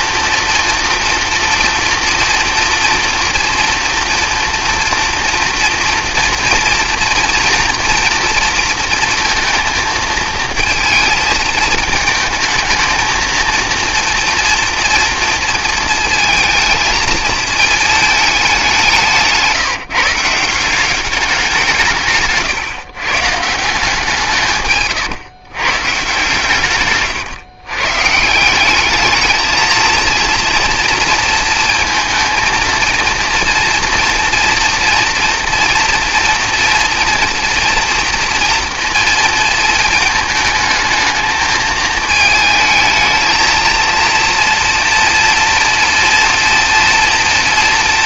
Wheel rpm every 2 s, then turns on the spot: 230, 230, 230, 230, 230, 220, 220, 240, 220, 190, 180, 130, 140, 140, 200, 230, 230, 230, 230, 230, 220, 220, 240, 230.
24-28